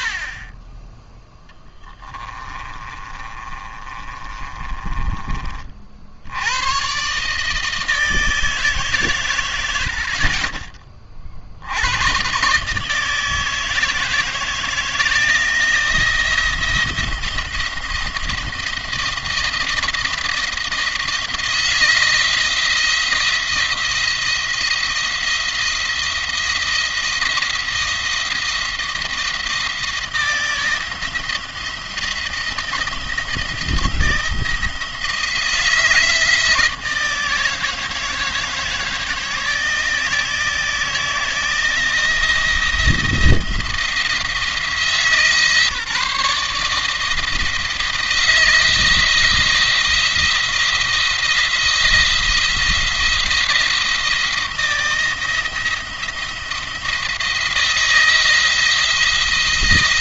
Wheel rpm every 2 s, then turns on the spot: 20, 30, 30, 110, 150, 40, 140, 160, 170, 160, 160, 170, 170, 170, 170, 170, 170, 160, 160, 160, 160, 170, 160, 160, 170, 170, 170, 160, 170, 170.
2-6